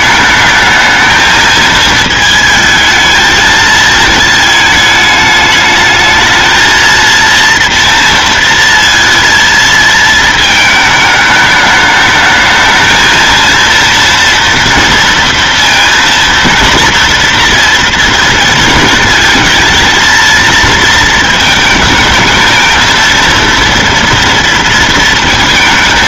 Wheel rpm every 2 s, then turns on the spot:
220, 220, 220, 220, 230, 220, 220, 230, 230, 230, 230, 220, 230.
none